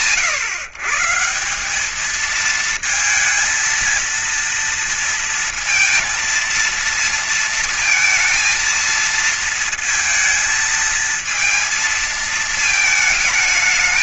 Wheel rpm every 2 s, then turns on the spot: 150, 220, 230, 230, 230, 220, 220.
none